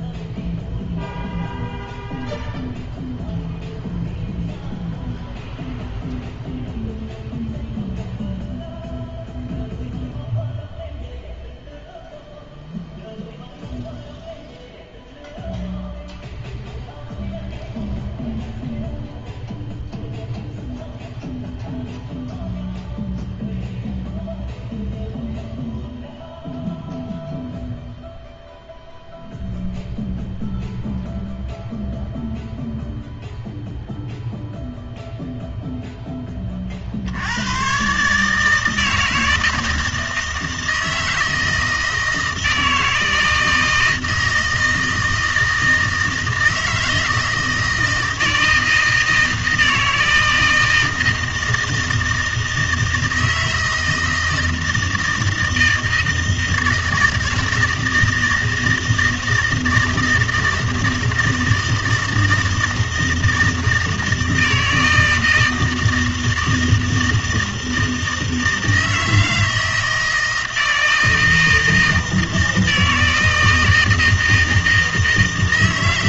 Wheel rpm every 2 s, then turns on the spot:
0, 0, 0, 0, 0, 0, 0, 0, 0, 0, 0, 0, 0, 0, 0, 0, 0, 0, 40, 150, 160, 160, 160, 160, 160, 160, 160, 160, 160, 160, 160, 160, 160, 160, 160, 160, 160, 160.
none